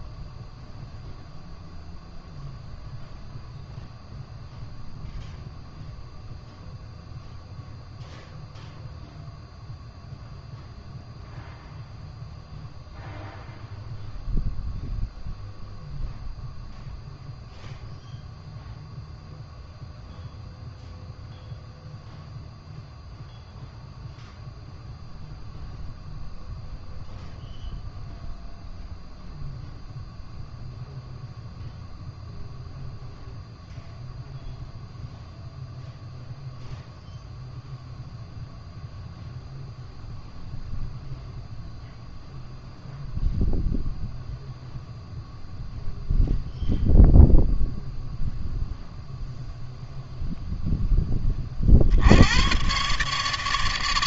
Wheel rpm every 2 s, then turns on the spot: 0, 0, 0, 0, 0, 0, 0, 0, 0, 0, 0, 0, 0, 0, 0, 0, 0, 0, 0, 0, 0, 0, 0, 0, 0, 0, 120.
none